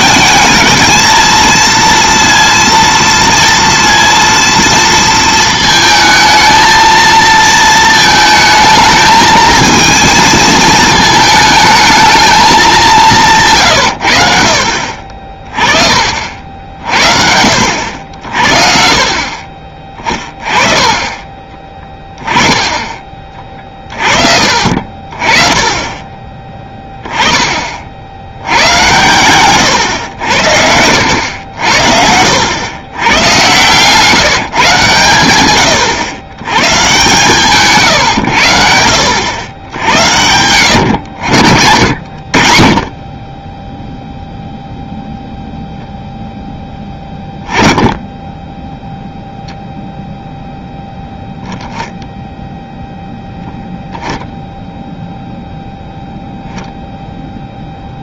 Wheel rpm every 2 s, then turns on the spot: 220, 230, 230, 220, 220, 220, 200, 60, 60, 40, 20, 20, 50, 20, 110, 90, 110, 140, 130, 80, 90, 30, 0, 10, 0, 0, 0, 0, 0.
none